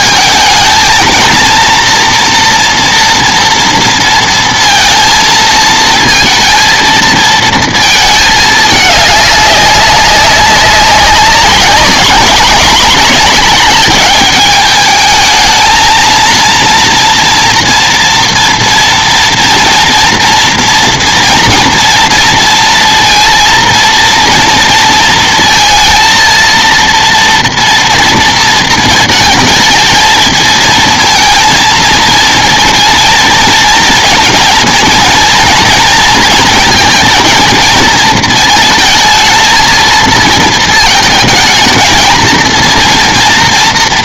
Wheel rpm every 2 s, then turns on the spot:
220, 230, 230, 230, 210, 200, 210, 210, 230, 230, 240, 230, 230, 230, 220, 220, 220, 220, 220, 220, 220, 230.
none